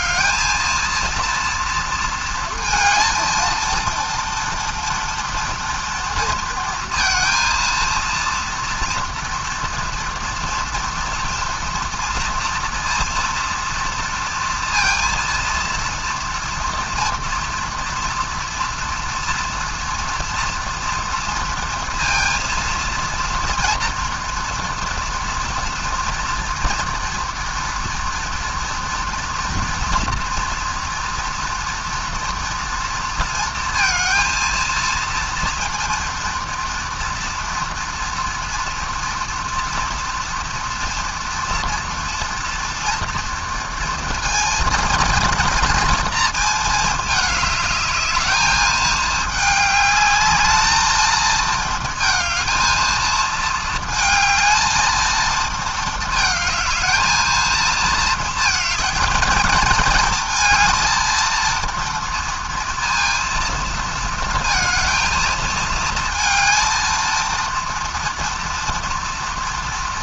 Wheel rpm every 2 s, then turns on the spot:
230, 230, 230, 230, 230, 230, 230, 230, 230, 230, 240, 230, 240, 230, 230, 230, 230, 230, 230, 230, 230, 230, 230, 220, 220, 210, 220, 220, 220, 220, 220, 230, 230, 230, 230.
none